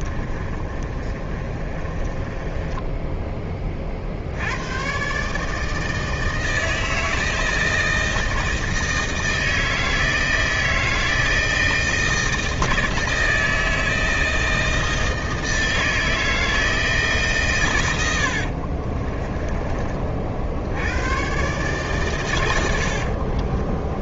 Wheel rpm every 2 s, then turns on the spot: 30, 10, 110, 160, 160, 160, 160, 160, 160, 50, 80, 70.
0-4 18-20 22-24